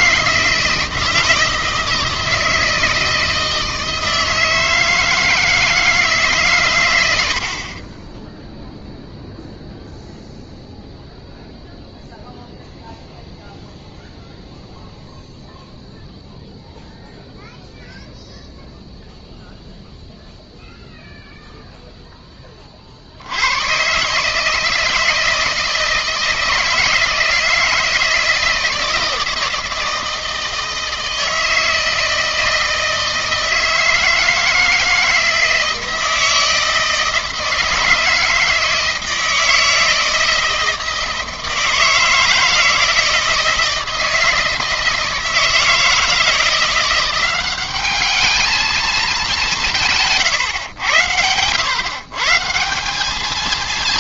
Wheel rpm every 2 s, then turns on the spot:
160, 160, 160, 130, 0, 0, 0, 0, 0, 0, 0, 40, 160, 160, 160, 160, 160, 160, 160, 160, 160, 160, 160, 170, 220, 110, 170.
none